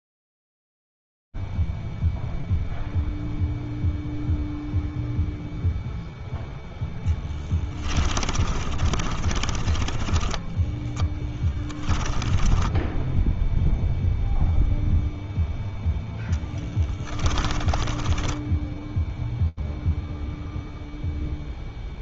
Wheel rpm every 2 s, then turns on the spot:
0, 0, 0, 0, 30, 10, 10, 0, 20, 0, 0.
8-14 16-18